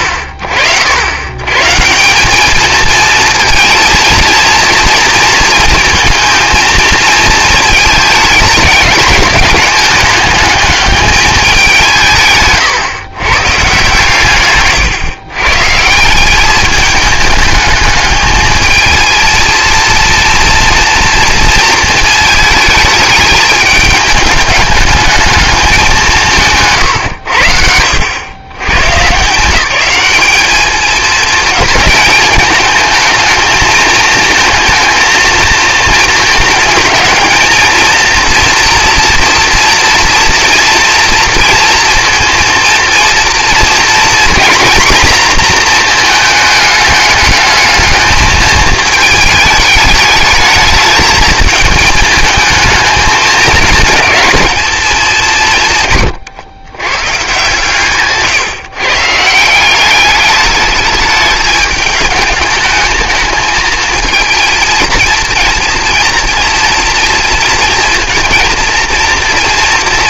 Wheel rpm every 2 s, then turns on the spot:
70, 210, 230, 220, 210, 210, 130, 140, 200, 220, 230, 220, 210, 150, 120, 210, 220, 220, 220, 230, 230, 230, 240, 210, 220, 210, 220, 210, 140, 140, 210, 210, 230, 230, 230.
14-16